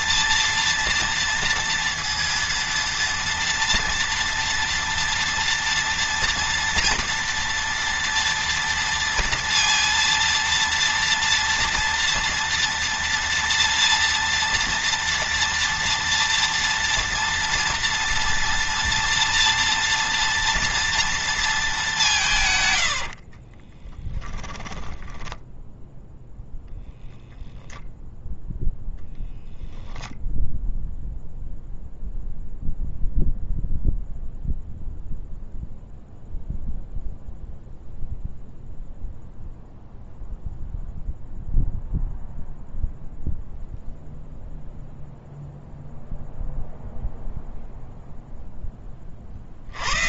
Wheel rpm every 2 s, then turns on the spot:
230, 230, 230, 230, 230, 230, 230, 230, 230, 230, 230, 110, 10, 0, 0, 0, 0, 0, 0, 0, 0, 0, 0, 0, 20.
22-26